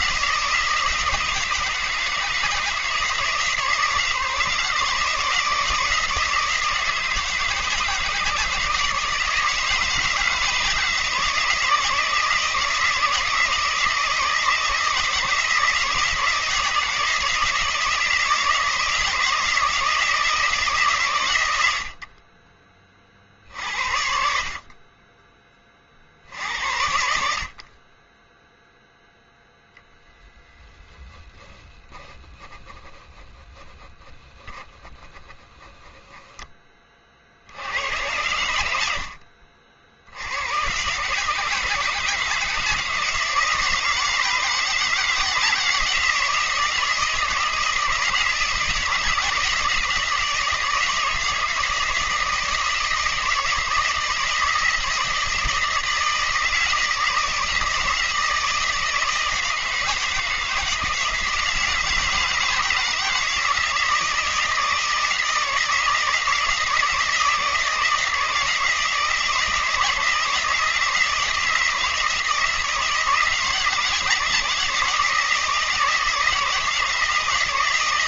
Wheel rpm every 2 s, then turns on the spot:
170, 160, 160, 160, 160, 160, 160, 160, 170, 160, 150, 30, 40, 80, 0, 10, 20, 10, 20, 80, 120, 160, 160, 160, 160, 160, 160, 160, 160, 160, 160, 160, 160, 160, 160, 160, 160, 160, 160.
none